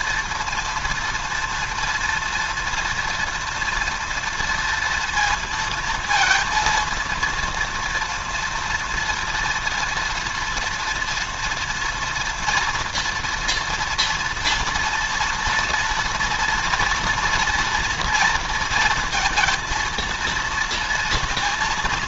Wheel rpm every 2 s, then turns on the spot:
230, 230, 230, 230, 240, 230, 230, 230, 230, 230, 230.
none